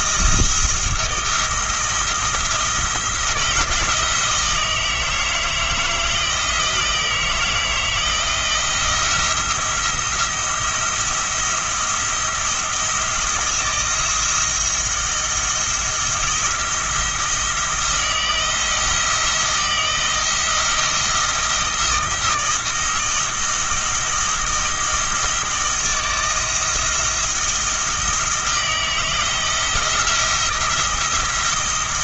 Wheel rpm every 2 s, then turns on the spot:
170, 170, 160, 160, 170, 170, 170, 170, 170, 170, 170, 160, 160, 170, 160, 170.
none